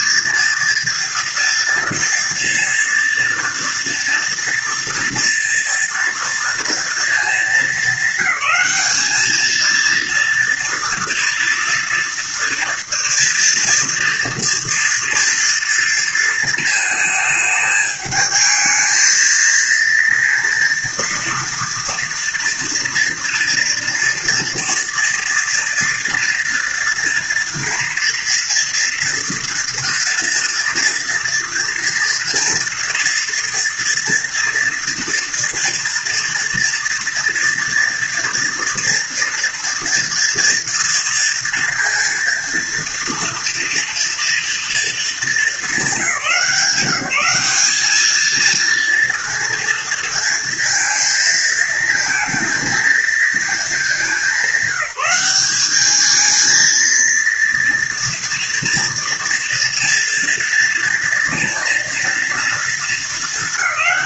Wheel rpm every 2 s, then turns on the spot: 230, 230, 230, 230, 220, 230, 230, 230, 220, 220, 230, 230, 230, 230, 230, 230, 230, 230, 230, 230, 230, 230, 220, 180, 230, 230, 230, 190, 230, 230, 230, 220.
none